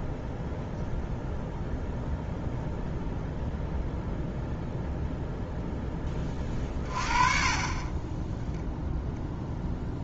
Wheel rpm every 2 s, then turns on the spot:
0, 0, 0, 30, 0.
none